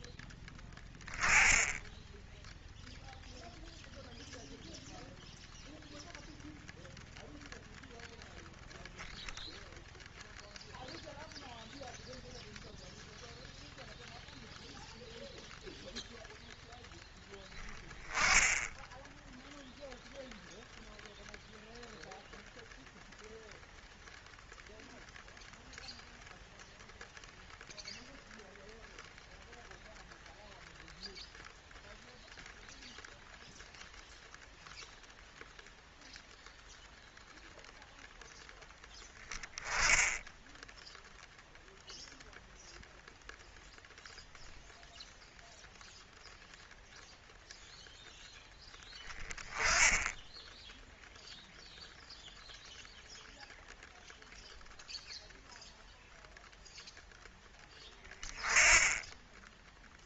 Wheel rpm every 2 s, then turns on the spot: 20, 0, 0, 0, 0, 0, 0, 0, 0, 0, 0, 0, 0, 0, 0, 0, 0, 0, 0, 10, 0, 0, 0, 0, 20, 0, 0, 0, 0, 10.
none